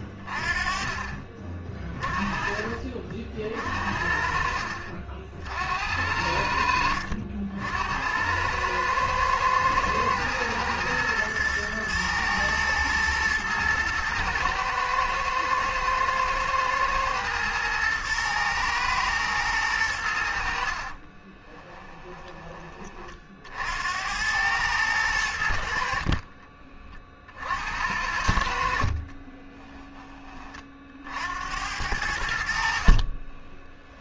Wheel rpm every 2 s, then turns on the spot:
30, 40, 50, 70, 100, 120, 110, 110, 120, 110, 60, 20, 100, 30, 60, 40, 60.
none